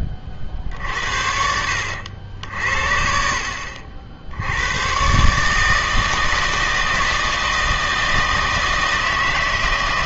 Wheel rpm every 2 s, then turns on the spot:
50, 70, 90, 160, 160.
none